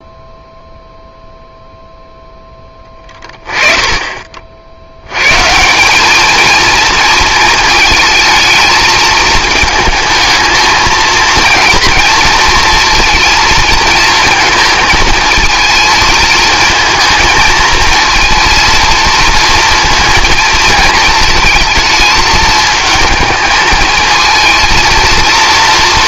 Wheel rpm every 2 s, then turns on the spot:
0, 10, 80, 230, 220, 230, 230, 220, 230, 230, 220, 220, 230.
none